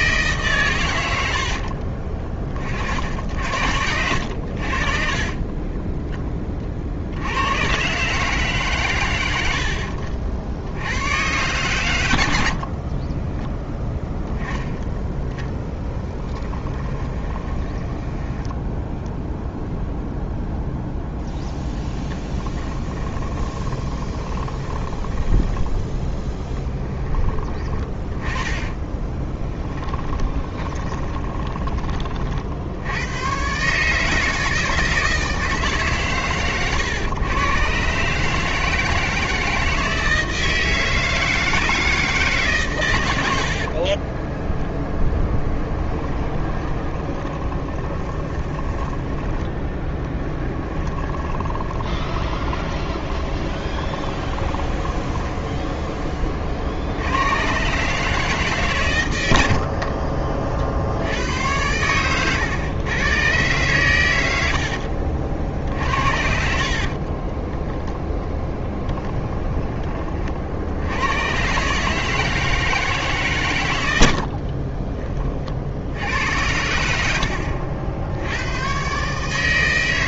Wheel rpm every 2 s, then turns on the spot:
120, 40, 50, 50, 120, 90, 40, 10, 20, 0, 0, 20, 20, 10, 20, 20, 70, 160, 120, 160, 160, 130, 20, 20, 10, 20, 20, 20, 50, 130, 70, 120, 60, 50, 10, 70, 160, 30, 90, 120.
16-18 22-26 28-32 46-48 50-56 64-68 74-76